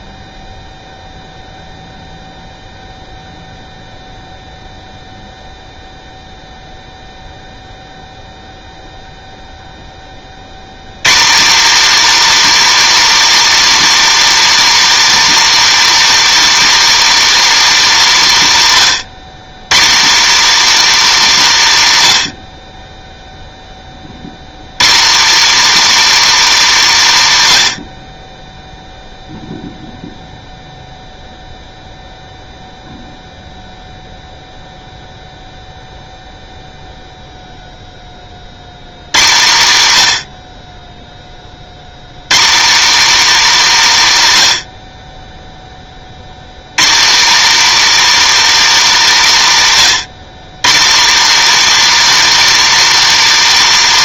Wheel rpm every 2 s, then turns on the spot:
0, 0, 0, 0, 0, 130, 320, 320, 320, 180, 290, 30, 160, 240, 0, 0, 0, 0, 0, 100, 30, 250, 60, 180, 290, 220, 320.
none